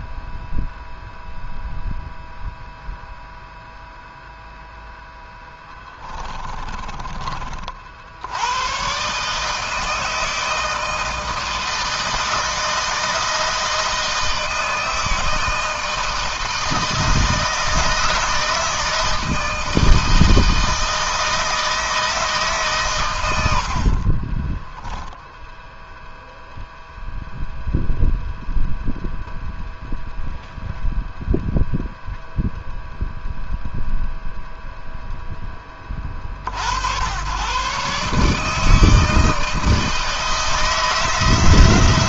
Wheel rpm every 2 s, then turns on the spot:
0, 0, 0, 20, 130, 160, 160, 160, 160, 160, 160, 130, 10, 0, 0, 0, 0, 0, 70, 160, 160.
6-8